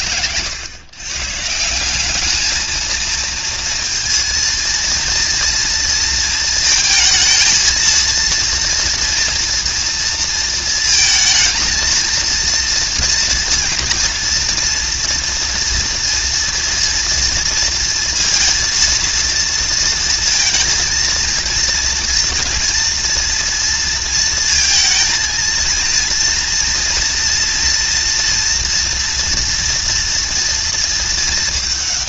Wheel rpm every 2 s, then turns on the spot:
120, 220, 230, 220, 230, 220, 230, 230, 230, 230, 230, 230, 230, 230, 230, 220.
none